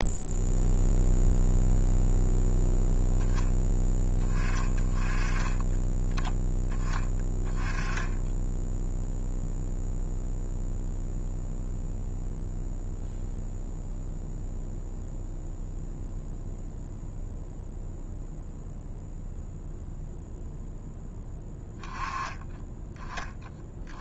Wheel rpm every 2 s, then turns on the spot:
0, 0, 20, 10, 10, 0, 0, 0, 0, 0, 0, 10.
none